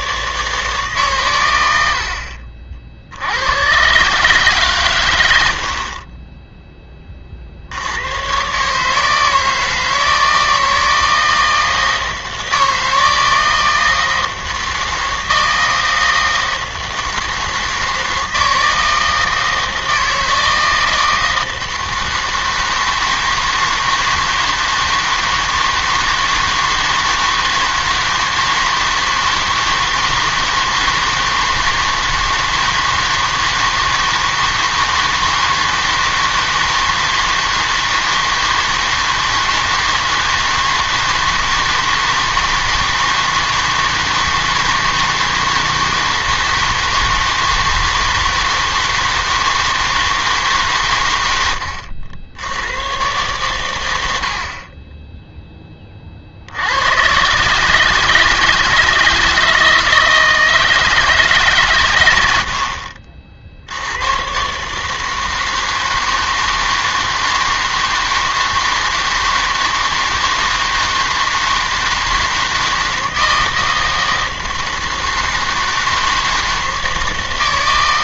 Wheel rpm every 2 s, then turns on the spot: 140, 50, 140, 10, 140, 160, 160, 160, 160, 160, 160, 160, 160, 160, 160, 160, 160, 160, 160, 160, 160, 160, 160, 160, 160, 140, 90, 30, 80, 160, 160, 80, 140, 160, 160, 160, 160, 160, 160.
none